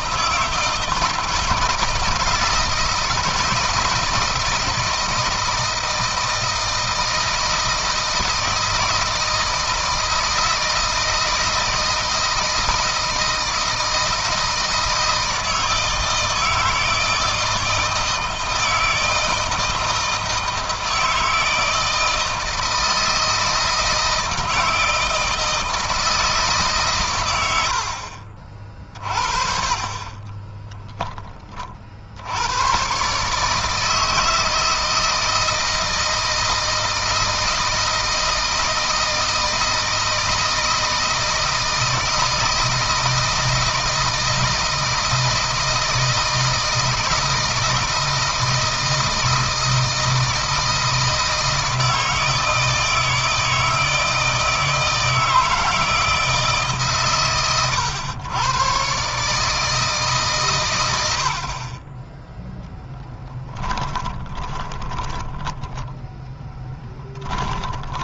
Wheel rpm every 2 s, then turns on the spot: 160, 160, 160, 160, 160, 160, 160, 160, 160, 160, 160, 160, 160, 130, 40, 20, 120, 160, 160, 160, 160, 160, 160, 160, 160, 160, 160, 160, 140, 130, 100, 10, 30, 10.
62-68